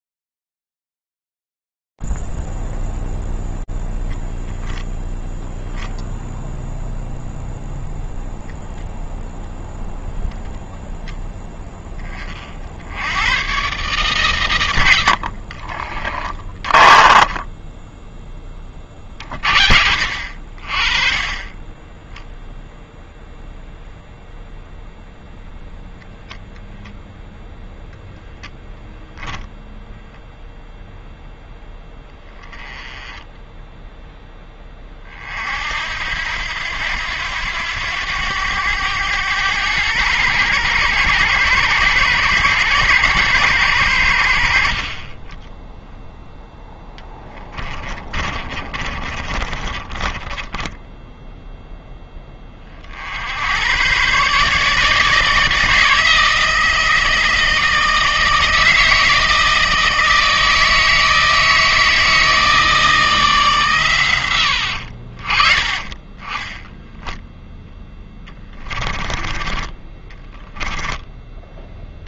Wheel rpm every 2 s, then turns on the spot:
20, 20, 0, 0, 0, 0, 40, 140, 30, 20, 50, 0, 0, 0, 0, 0, 20, 20, 90, 100, 100, 120, 50, 0, 30, 10, 40, 150, 160, 160, 160, 160, 70, 10, 20, 20.
0-4 16-18 48-52 66-72